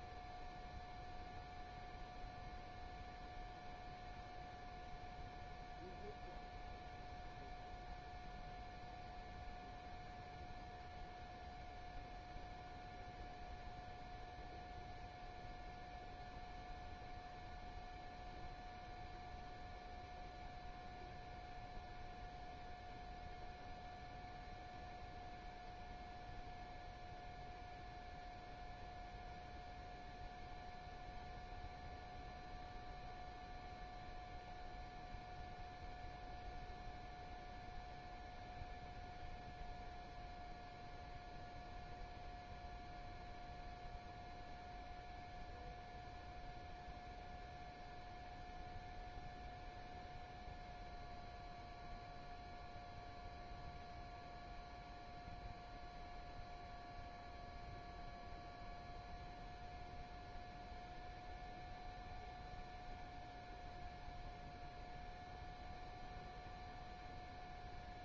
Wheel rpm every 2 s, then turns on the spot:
0, 0, 0, 0, 0, 0, 0, 0, 0, 0, 0, 0, 0, 0, 0, 0, 0, 0, 0, 0, 0, 0, 0, 0, 0, 0, 0, 0, 0, 0, 0, 0, 0, 0.
none